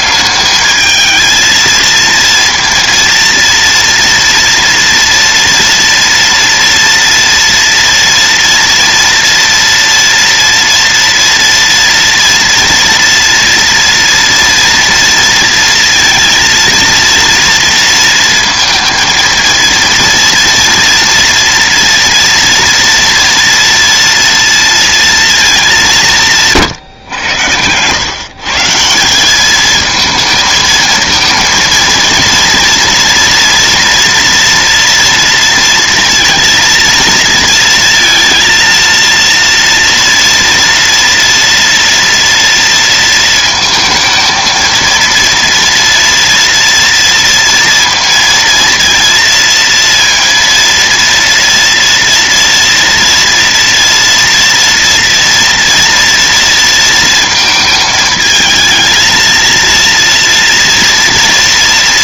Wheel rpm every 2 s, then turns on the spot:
210, 230, 230, 230, 230, 230, 230, 230, 230, 230, 230, 230, 230, 140, 150, 220, 230, 230, 230, 230, 230, 230, 230, 240, 230, 230, 230, 230, 230, 220, 230.
none